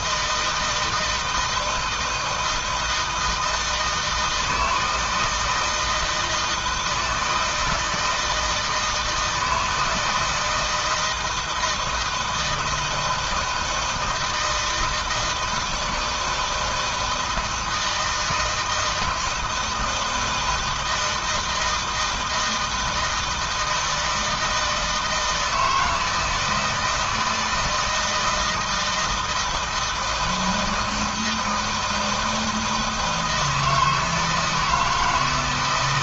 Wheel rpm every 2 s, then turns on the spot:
170, 160, 160, 160, 160, 160, 160, 160, 160, 160, 160, 160, 160, 160, 160, 160, 160, 160.
none